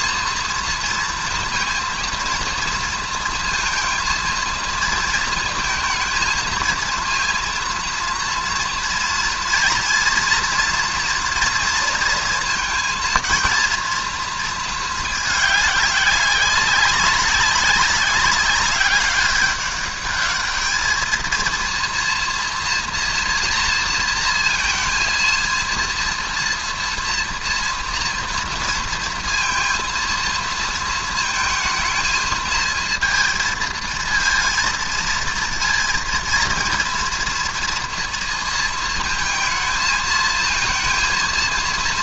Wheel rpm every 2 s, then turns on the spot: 230, 230, 220, 220, 230, 240, 230, 220, 190, 200, 220, 230, 230, 230, 230, 230, 220, 230, 230, 230, 230.
none